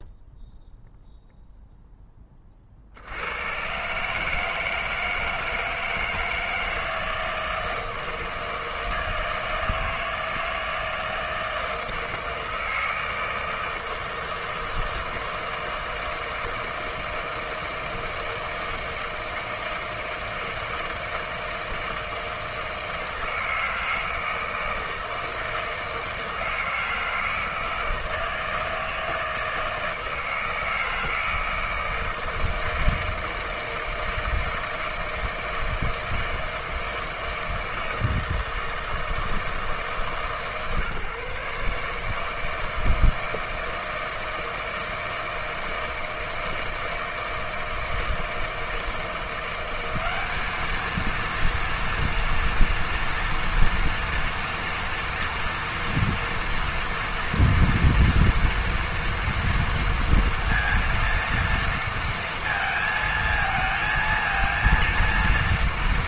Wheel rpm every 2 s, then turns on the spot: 0, 50, 160, 160, 160, 160, 160, 160, 160, 160, 160, 160, 160, 160, 160, 160, 160, 160, 160, 160, 150, 160, 160, 160, 160, 210, 230, 230, 230, 240, 230, 230, 230.
none